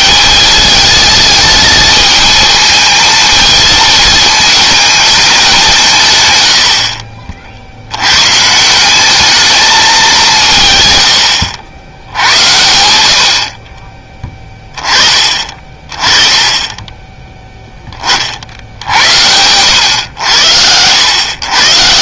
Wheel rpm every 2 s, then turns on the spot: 220, 220, 220, 60, 180, 130, 80, 20, 10, 70, 90.
none